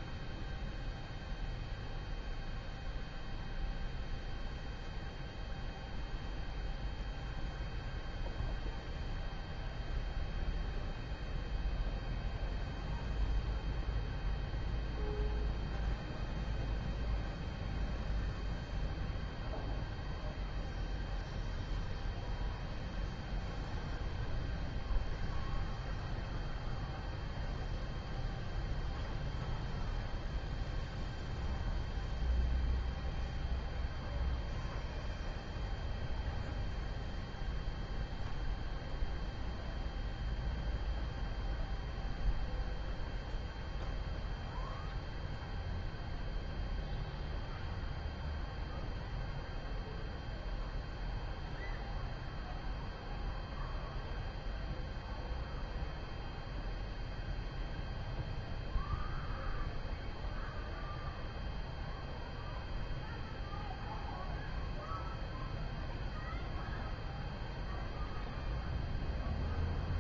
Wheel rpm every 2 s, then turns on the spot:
0, 0, 0, 0, 0, 0, 0, 0, 0, 0, 0, 0, 0, 0, 0, 0, 0, 0, 0, 0, 0, 0, 0, 0, 0, 0, 0, 0, 0, 0, 0, 0, 0, 0, 0.
none